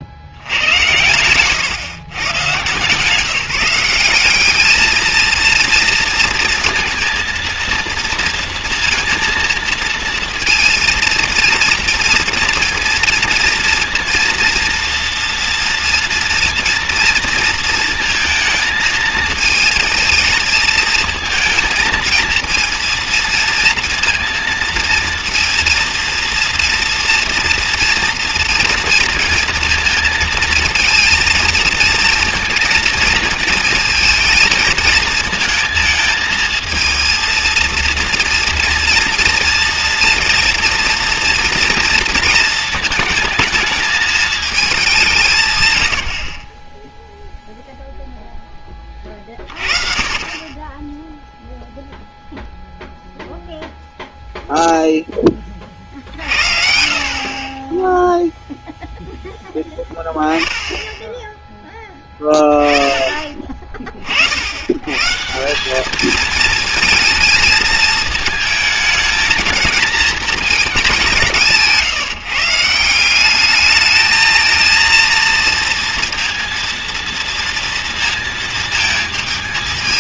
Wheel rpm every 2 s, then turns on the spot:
120, 150, 220, 230, 230, 230, 230, 230, 230, 220, 230, 230, 230, 230, 230, 230, 220, 220, 230, 230, 230, 220, 180, 0, 20, 0, 0, 0, 50, 0, 10, 20, 130, 220, 220, 190, 180, 230, 230, 230.
0-2